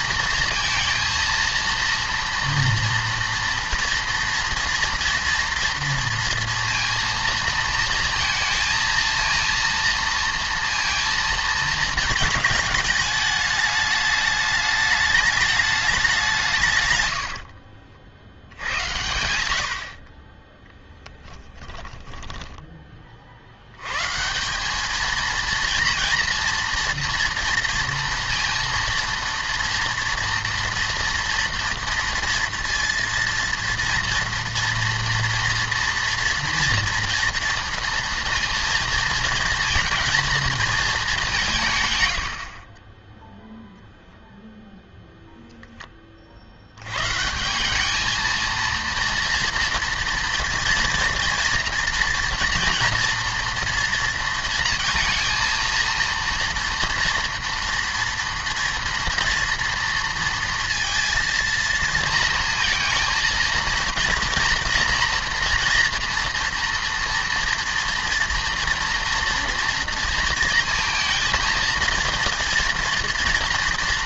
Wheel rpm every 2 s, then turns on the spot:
230, 230, 230, 230, 230, 230, 220, 210, 140, 90, 10, 10, 190, 230, 230, 230, 230, 230, 230, 230, 220, 40, 0, 90, 230, 230, 230, 230, 230, 230, 230, 230, 230, 230, 230, 230, 230.
none